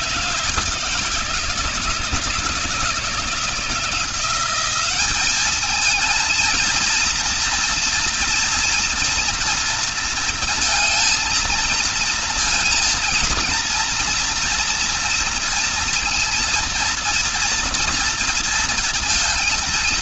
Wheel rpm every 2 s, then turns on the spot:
160, 150, 180, 230, 230, 230, 230, 230, 230, 230.
none